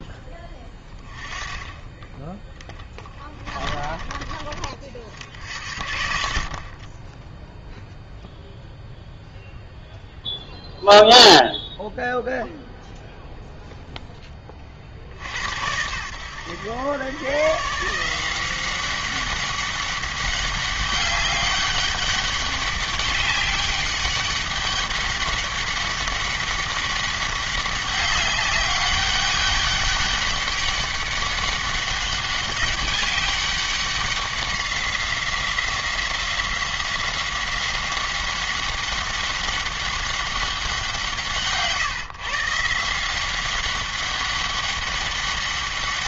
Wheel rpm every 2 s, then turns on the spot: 10, 10, 40, 20, 0, 0, 0, 40, 110, 190, 200, 200, 200, 200, 190, 200, 200, 190, 190, 190, 180, 160, 200.
2-4